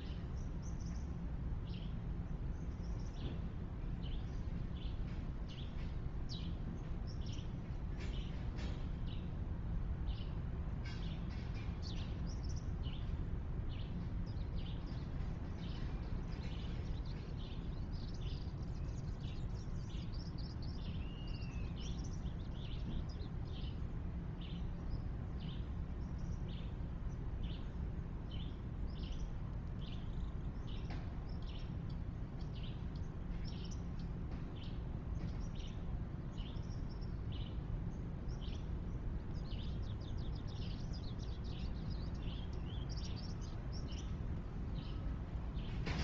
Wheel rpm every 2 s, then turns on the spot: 0, 0, 0, 0, 0, 0, 0, 0, 0, 0, 0, 0, 0, 0, 0, 0, 0, 0, 0, 0, 0, 0, 0.
none